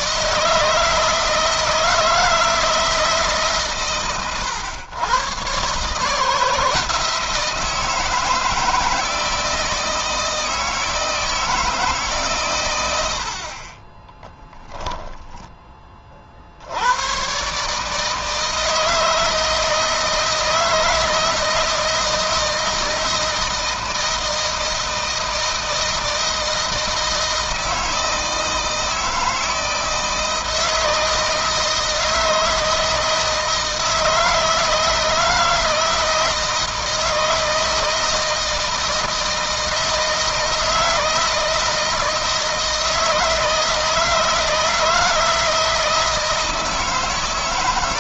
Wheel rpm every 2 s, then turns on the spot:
160, 160, 120, 160, 160, 160, 90, 10, 90, 160, 160, 160, 160, 160, 160, 160, 160, 160, 160, 160, 160, 160, 160, 160.
none